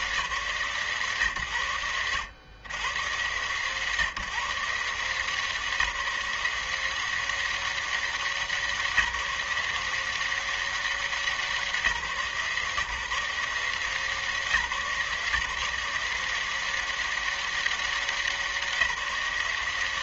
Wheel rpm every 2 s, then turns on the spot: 170, 80, 130, 180, 180, 180, 150, 160, 170, 190.
none